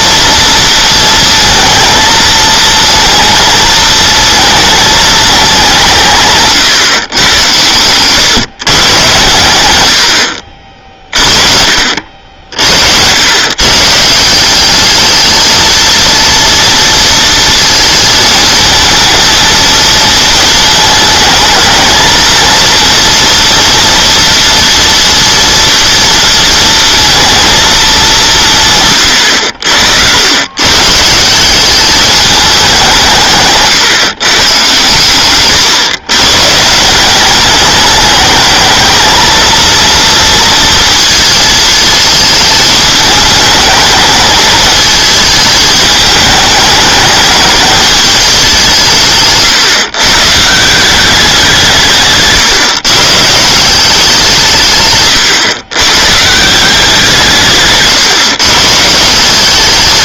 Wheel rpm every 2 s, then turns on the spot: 230, 230, 220, 130, 120, 30, 70, 210, 230, 220, 220, 230, 240, 230, 130, 140, 190, 120, 180, 220, 230, 210, 220, 210, 160, 180, 140, 140, 180, 150.
54-56